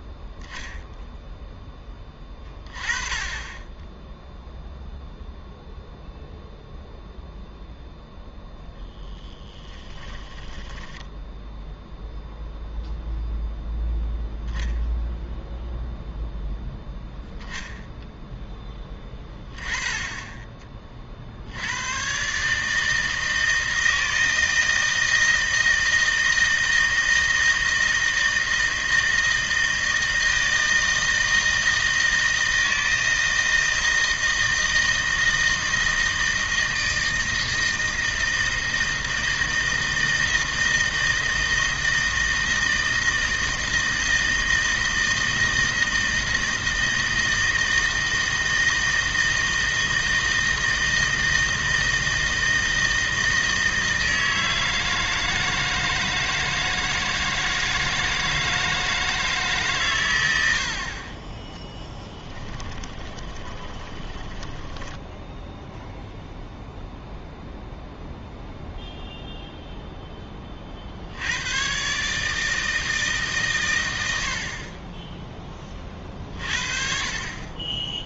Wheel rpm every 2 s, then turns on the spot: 0, 20, 0, 0, 0, 10, 0, 0, 0, 10, 30, 150, 160, 160, 160, 160, 160, 160, 160, 160, 160, 160, 160, 160, 160, 160, 160, 160, 160, 160, 60, 20, 10, 0, 0, 40, 160, 30, 50.
10-12 62-66